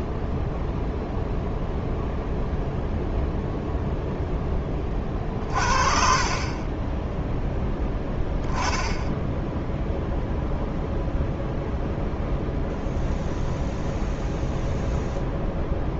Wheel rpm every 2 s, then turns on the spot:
0, 0, 20, 10, 0, 0, 0, 0.
none